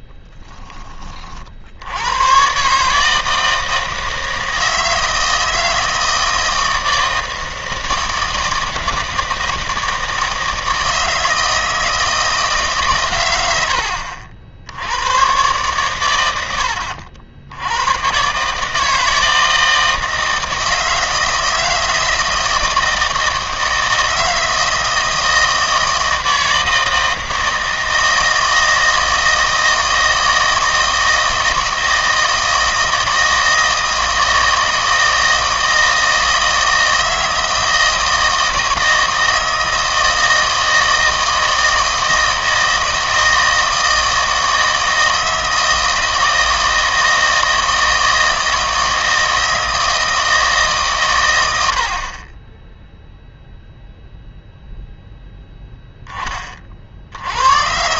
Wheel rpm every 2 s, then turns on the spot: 20, 140, 160, 160, 160, 160, 150, 80, 80, 150, 160, 160, 160, 160, 160, 160, 160, 160, 160, 160, 160, 160, 160, 160, 160, 150, 10, 0, 40.
none